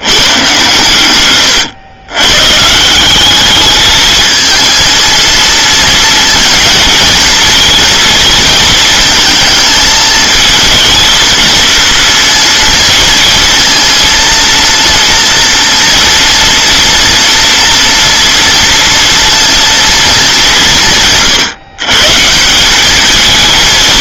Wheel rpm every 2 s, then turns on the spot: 120, 180, 230, 230, 220, 220, 230, 230, 230, 230, 150, 200.
none